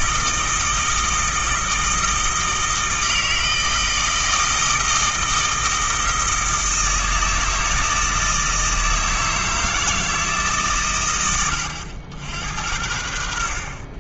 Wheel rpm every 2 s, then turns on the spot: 160, 160, 160, 160, 160, 110, 70.
none